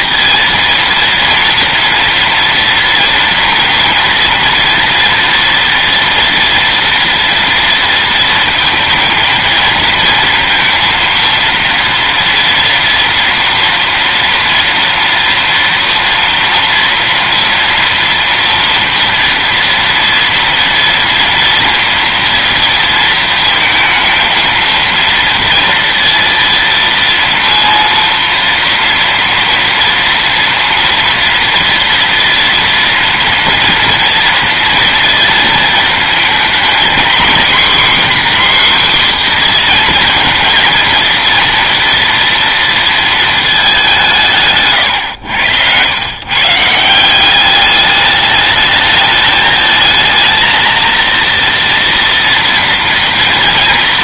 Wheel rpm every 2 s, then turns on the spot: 230, 240, 240, 230, 230, 230, 230, 230, 230, 230, 230, 230, 230, 230, 230, 230, 230, 230, 230, 260, 230, 230, 130, 160, 210, 230, 230.
none